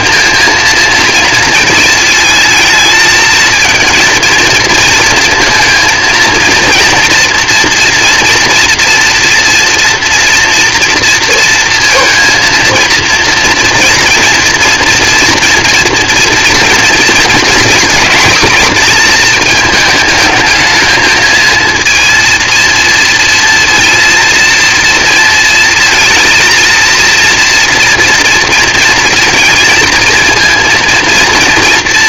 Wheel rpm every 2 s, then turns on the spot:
230, 220, 230, 230, 230, 230, 230, 230, 230, 230, 220, 230, 230, 230, 230, 230.
none